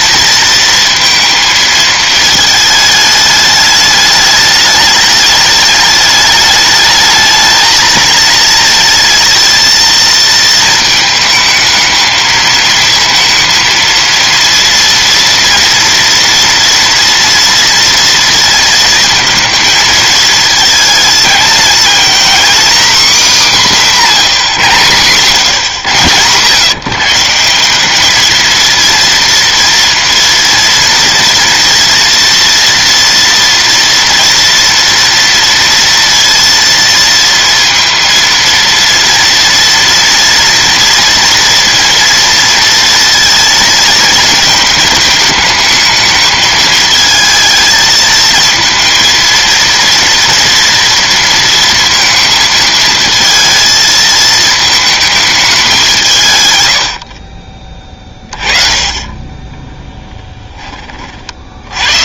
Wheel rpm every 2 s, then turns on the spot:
230, 220, 210, 210, 220, 220, 220, 230, 230, 220, 220, 270, 140, 140, 230, 230, 230, 230, 230, 230, 230, 230, 220, 220, 230, 230, 230, 220, 100, 30, 20.
none